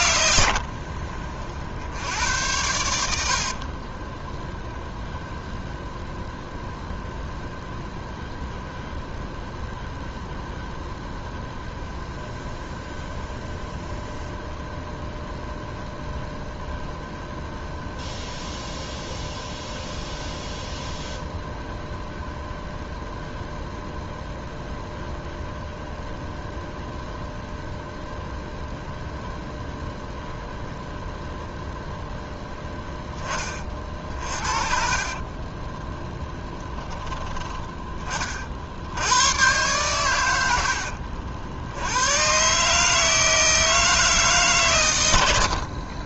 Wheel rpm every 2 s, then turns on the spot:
50, 90, 0, 0, 0, 0, 0, 0, 0, 0, 0, 0, 0, 0, 0, 0, 10, 40, 10, 60, 80, 150, 140.
0-2 40-42